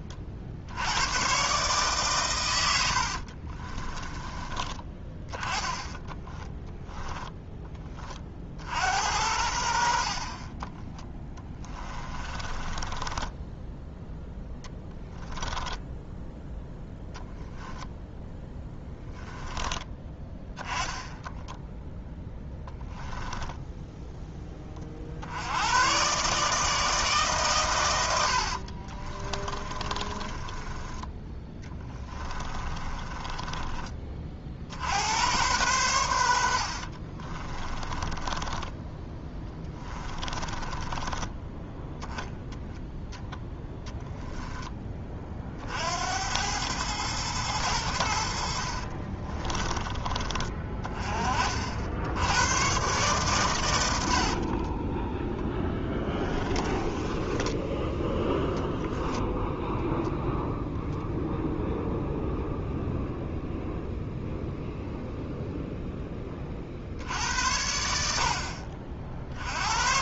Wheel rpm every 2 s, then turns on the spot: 70, 80, 20, 10, 60, 20, 20, 10, 0, 10, 10, 10, 30, 150, 40, 20, 20, 70, 60, 10, 20, 10, 10, 100, 50, 30, 120, 20, 20, 0, 0, 0, 0, 50, 50.
2-4 6-8 10-16 18-20 28-34 36-42 48-50 54-58